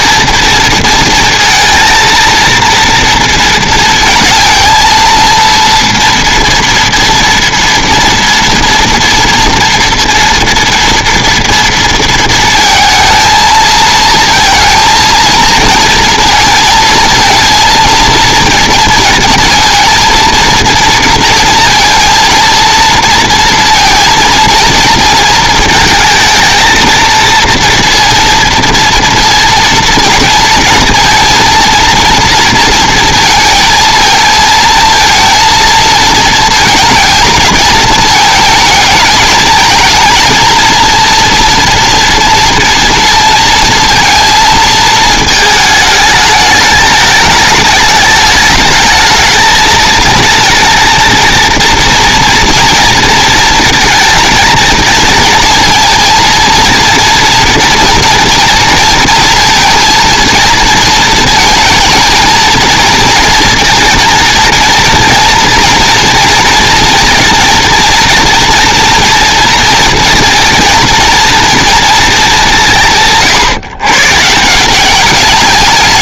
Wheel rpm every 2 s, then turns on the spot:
230, 230, 230, 230, 230, 230, 230, 230, 230, 230, 230, 230, 230, 220, 230, 230, 230, 230, 230, 210, 230, 230, 220, 220, 220, 230, 230, 230, 230, 230, 230, 230, 230, 230, 230, 230, 150, 180.
none